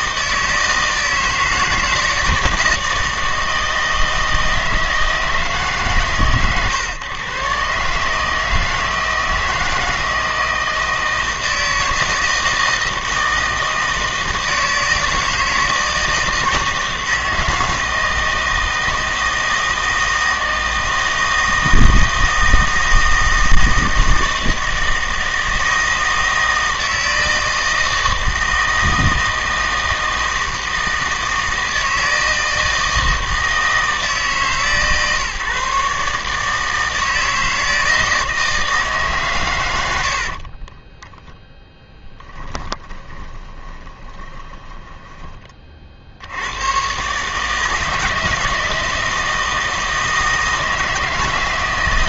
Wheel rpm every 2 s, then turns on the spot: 160, 160, 160, 120, 160, 160, 160, 160, 160, 160, 160, 160, 160, 160, 160, 160, 160, 140, 160, 160, 20, 10, 10, 110, 160, 160.
40-46